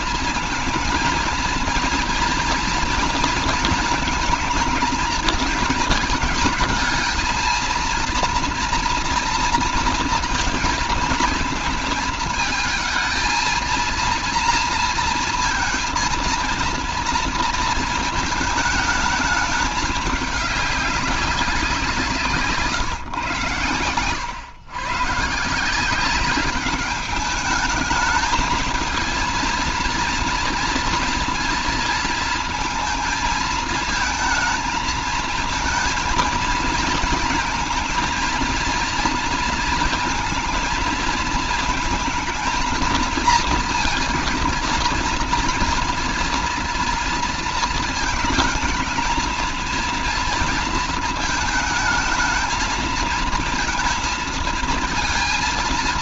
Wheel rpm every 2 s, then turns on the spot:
230, 240, 230, 220, 230, 230, 220, 230, 230, 220, 200, 150, 120, 200, 220, 230, 230, 220, 230, 230, 220, 220, 230, 230, 220, 230, 220, 230.
none